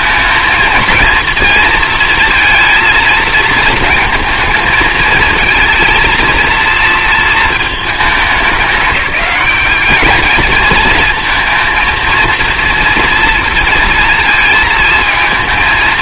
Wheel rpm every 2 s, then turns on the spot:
230, 230, 220, 230, 210, 220, 230, 230.
none